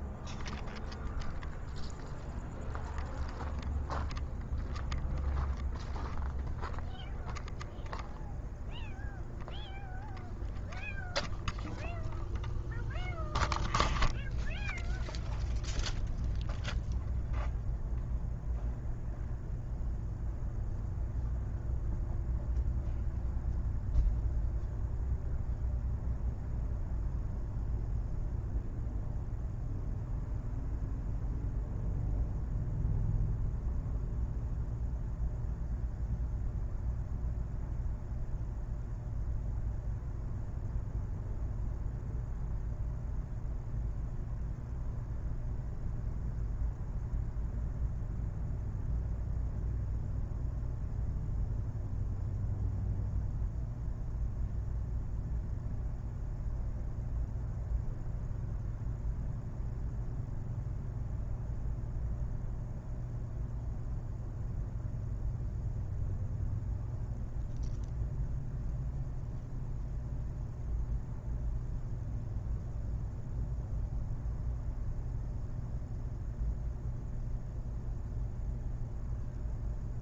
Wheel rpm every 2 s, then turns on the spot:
0, 0, 0, 0, 0, 0, 0, 0, 0, 0, 0, 0, 0, 0, 0, 0, 0, 0, 0, 0, 0, 0, 0, 0, 0, 0, 0, 0, 0, 0, 0, 0, 0, 0, 0, 0, 0, 0, 0, 0.
none